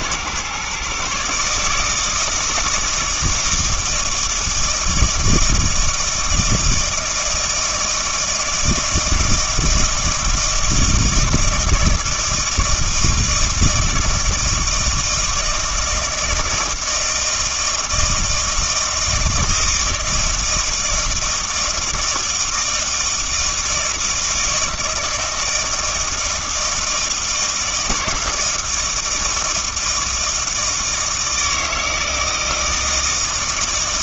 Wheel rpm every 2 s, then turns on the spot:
130, 160, 160, 160, 160, 160, 160, 160, 160, 160, 160, 160, 160, 160, 160, 160, 160.
none